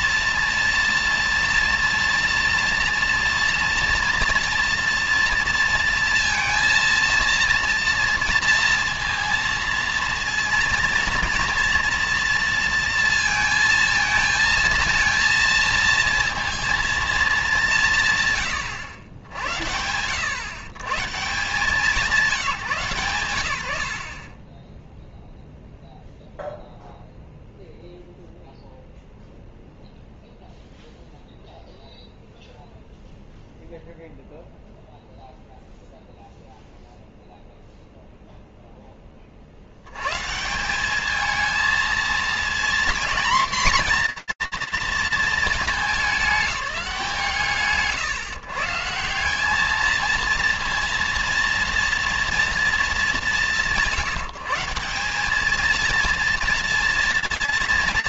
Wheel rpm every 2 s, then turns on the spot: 230, 230, 240, 230, 230, 230, 230, 220, 230, 130, 120, 180, 30, 0, 0, 0, 0, 0, 0, 0, 150, 230, 230, 190, 150, 230, 210, 180, 230.
none